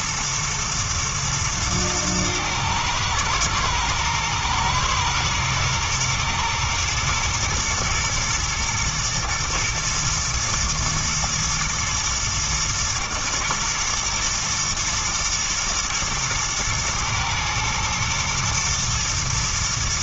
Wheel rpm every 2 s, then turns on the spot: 110, 110, 110, 110, 120, 110, 110, 110, 110, 120.
none